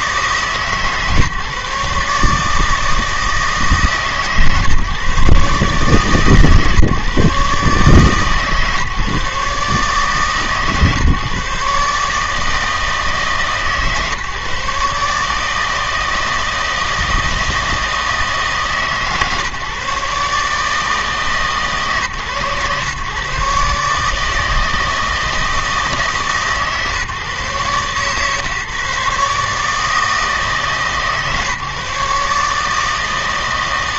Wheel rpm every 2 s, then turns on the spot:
140, 150, 140, 140, 150, 140, 150, 140, 160, 150, 150, 130, 160, 140, 130, 160, 150.
none